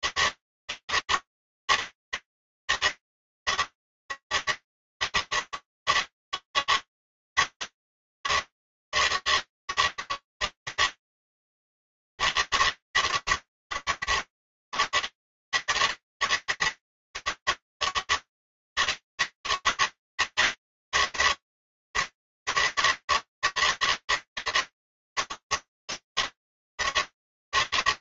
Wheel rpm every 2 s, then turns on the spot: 160, 160, 150, 150, 150, 160, 150, 140, 150, 160, 140, 150, 160, 150.
none